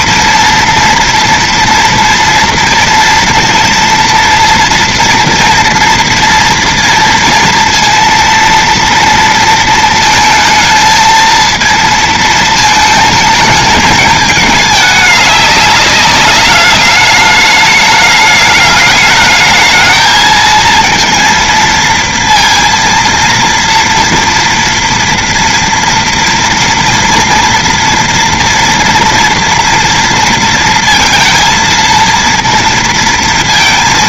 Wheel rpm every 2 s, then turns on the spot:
230, 230, 230, 230, 230, 220, 230, 220, 210, 210, 220, 230, 230, 230, 230, 230, 230.
none